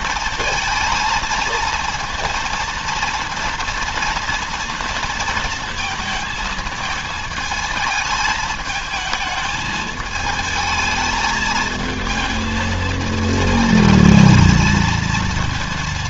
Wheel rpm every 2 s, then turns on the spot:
220, 230, 230, 220, 220, 220, 220, 230.
none